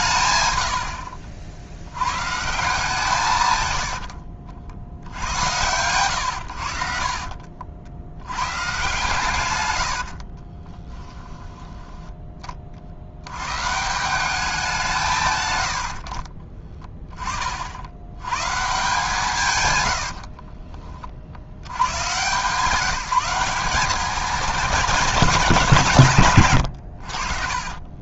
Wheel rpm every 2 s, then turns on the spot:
110, 160, 70, 80, 120, 30, 30, 190, 30, 140, 40, 150, 210, 110.
10-12 16-18 20-22